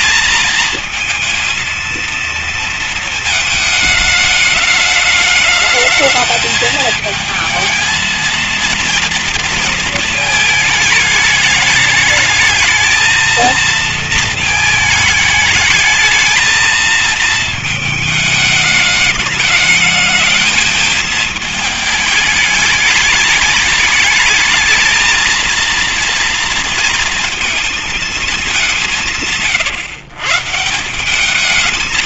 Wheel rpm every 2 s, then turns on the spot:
220, 230, 210, 220, 230, 220, 220, 220, 220, 210, 220, 210, 220, 230, 180, 180.
none